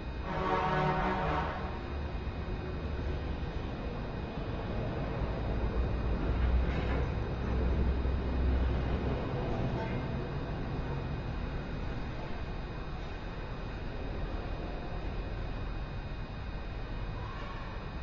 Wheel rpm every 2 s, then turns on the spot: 0, 0, 0, 0, 0, 0, 0, 0, 0.
none